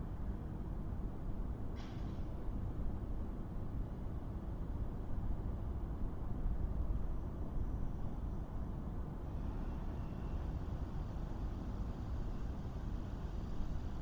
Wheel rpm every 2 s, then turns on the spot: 0, 0, 0, 0, 0, 0, 0.
none